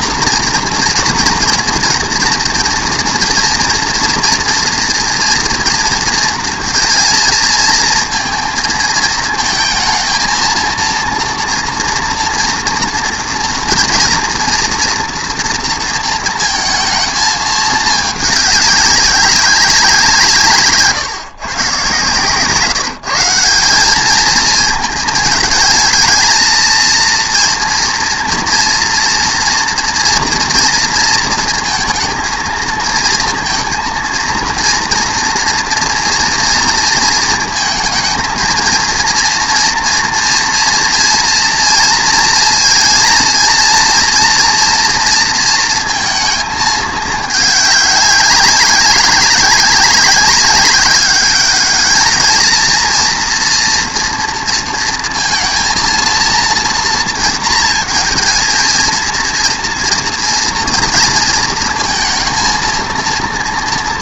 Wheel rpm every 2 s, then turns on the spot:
230, 230, 230, 230, 230, 230, 230, 230, 220, 200, 150, 140, 220, 230, 230, 230, 220, 230, 230, 220, 230, 230, 230, 220, 200, 200, 220, 230, 230, 230, 230, 230.
none